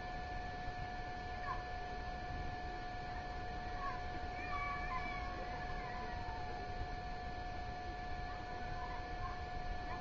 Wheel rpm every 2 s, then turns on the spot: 0, 0, 0, 0, 0.
none